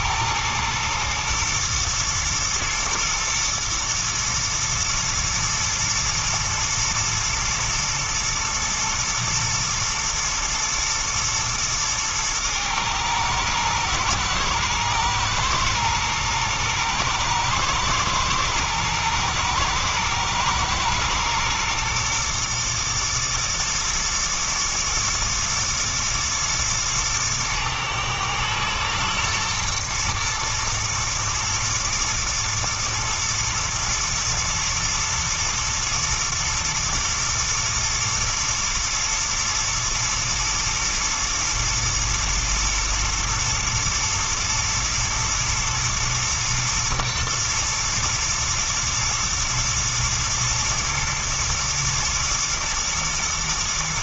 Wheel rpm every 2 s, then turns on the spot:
110, 110, 110, 110, 110, 110, 110, 120, 120, 120, 110, 110, 120, 120, 110, 110, 110, 110, 120, 110, 120, 110, 110, 120, 110, 120, 110.
none